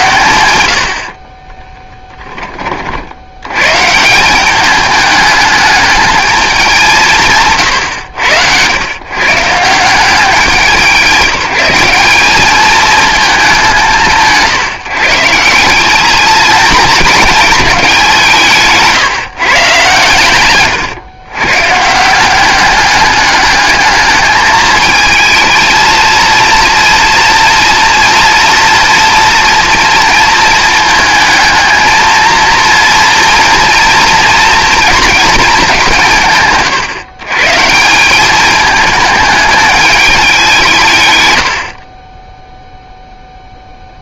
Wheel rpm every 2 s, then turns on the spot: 90, 40, 200, 180, 110, 180, 220, 150, 230, 150, 120, 200, 220, 230, 230, 220, 230, 230, 150, 210, 160, 0.
none